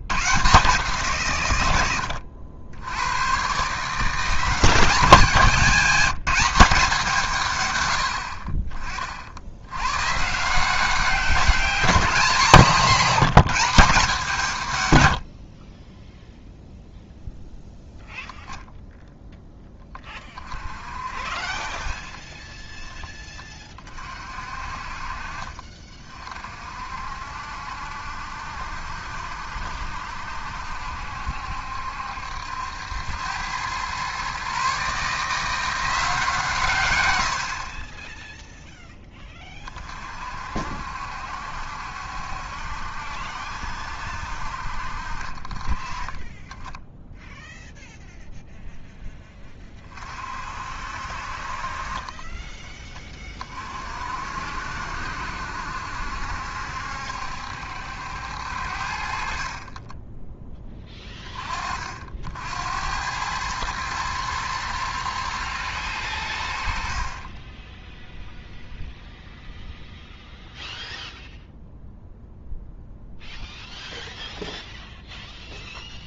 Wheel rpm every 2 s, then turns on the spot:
160, 80, 180, 190, 50, 170, 190, 140, 0, 20, 30, 10, 50, 50, 70, 70, 80, 140, 150, 0, 60, 70, 60, 10, 0, 50, 10, 60, 70, 70, 10, 80, 110, 70, 0, 0, 0, 0.
22-24